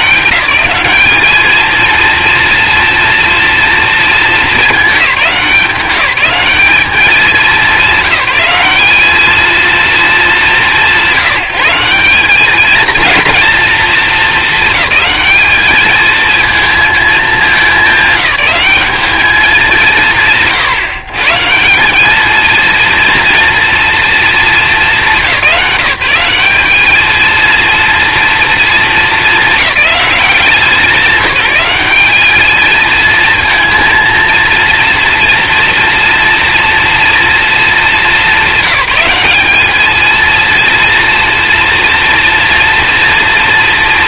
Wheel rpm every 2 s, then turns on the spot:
220, 230, 190, 190, 230, 180, 230, 220, 210, 180, 170, 230, 170, 230, 210, 200, 230, 230, 230, 210, 240, 230.
none